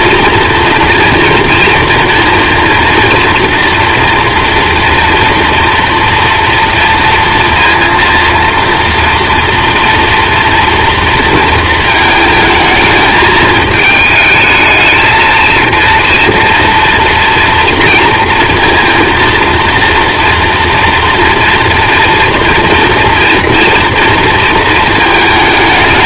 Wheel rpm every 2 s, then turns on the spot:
230, 230, 230, 230, 230, 240, 220, 220, 230, 230, 230, 230, 230.
none